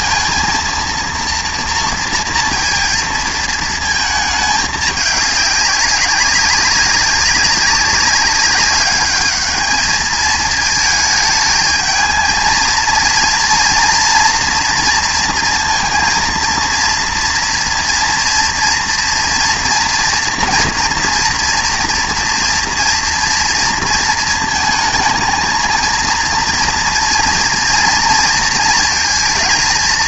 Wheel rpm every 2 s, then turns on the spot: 230, 230, 210, 190, 200, 220, 230, 230, 230, 230, 230, 230, 220, 240, 230.
none